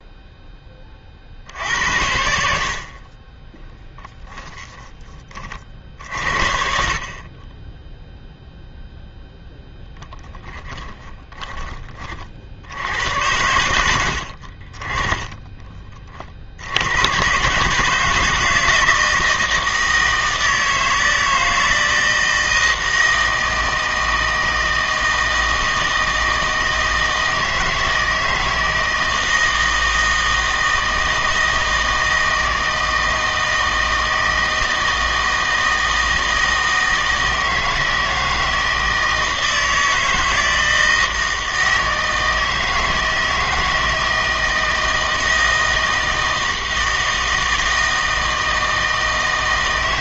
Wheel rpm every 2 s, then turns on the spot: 20, 50, 10, 50, 0, 10, 70, 40, 70, 160, 160, 160, 160, 160, 160, 160, 160, 160, 160, 160, 160, 160, 160, 160, 160.
4-6 10-12